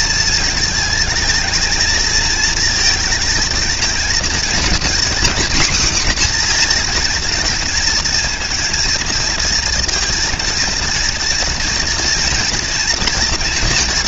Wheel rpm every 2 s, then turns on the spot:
220, 230, 240, 240, 230, 230, 230.
none